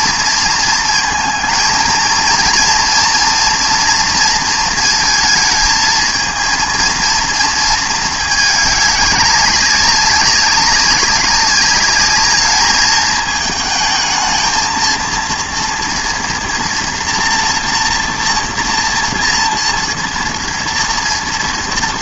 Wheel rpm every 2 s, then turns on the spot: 230, 230, 230, 230, 210, 200, 210, 230, 240, 240, 230.
none